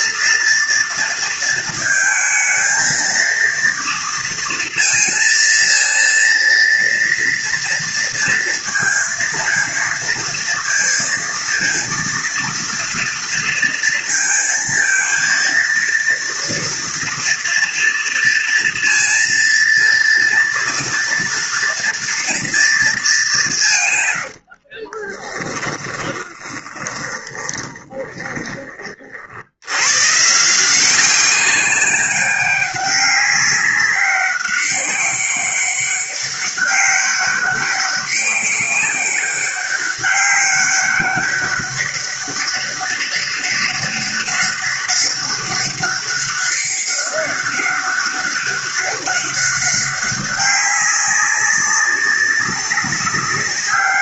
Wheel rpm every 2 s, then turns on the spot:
230, 230, 230, 230, 230, 230, 230, 230, 240, 230, 230, 230, 60, 20, 20, 160, 200, 200, 200, 200, 200, 200, 200, 200, 200, 200, 190.
24-28